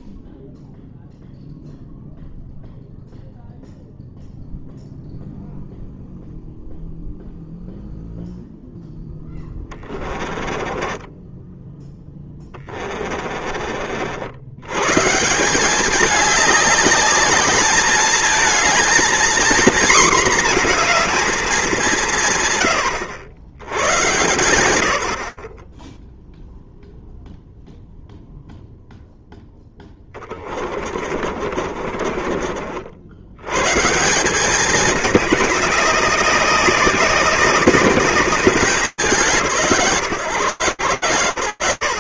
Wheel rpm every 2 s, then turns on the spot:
0, 0, 0, 0, 10, 10, 30, 180, 210, 240, 230, 100, 30, 0, 0, 40, 100, 210, 200, 160, 120.
8-14 30-32